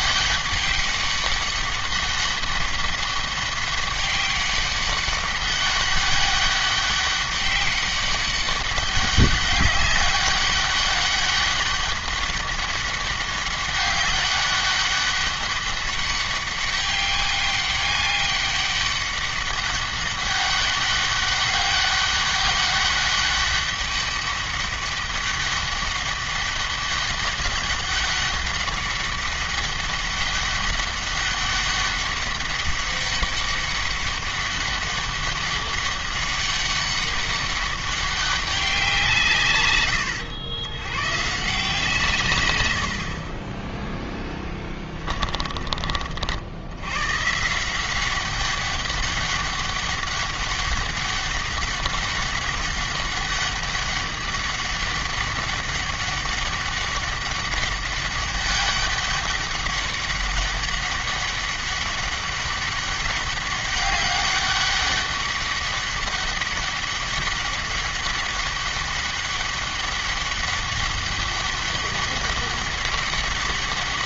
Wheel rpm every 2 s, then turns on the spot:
200, 200, 200, 200, 200, 200, 200, 200, 200, 200, 200, 200, 200, 200, 200, 200, 200, 200, 200, 180, 110, 90, 20, 100, 200, 200, 200, 200, 200, 200, 200, 200, 200, 200, 200, 200, 200.
44-46